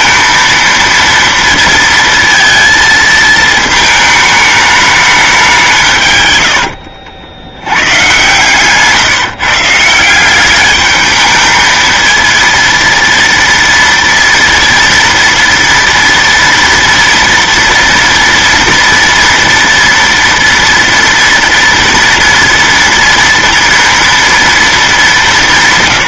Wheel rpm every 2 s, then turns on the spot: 230, 230, 210, 80, 130, 200, 230, 230, 230, 230, 230, 230, 230.
6-10